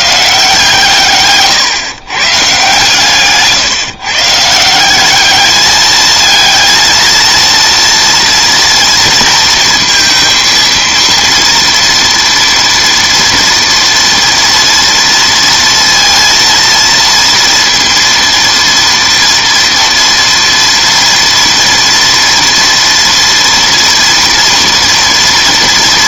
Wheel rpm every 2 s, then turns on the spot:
150, 140, 170, 220, 230, 230, 240, 230, 230, 230, 230, 230, 230.
none